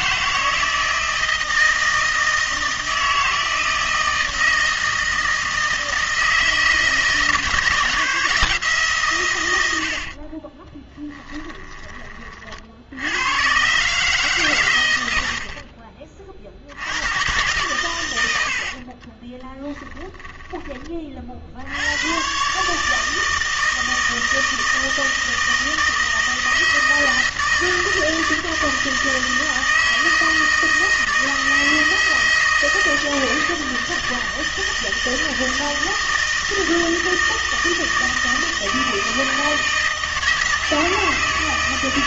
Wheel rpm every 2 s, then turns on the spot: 160, 160, 160, 160, 160, 30, 60, 130, 60, 70, 20, 150, 160, 160, 160, 160, 160, 160, 160, 160, 160.
10-12 18-20